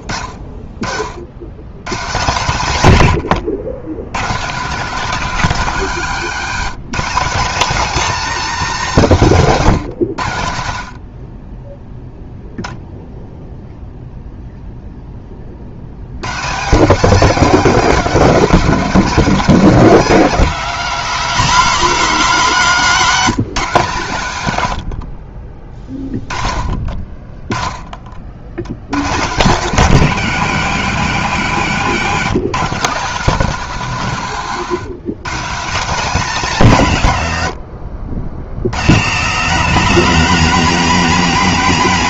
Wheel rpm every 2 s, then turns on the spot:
60, 120, 200, 210, 220, 60, 0, 0, 210, 230, 230, 200, 90, 40, 100, 140, 170, 160, 170, 130, 230.
none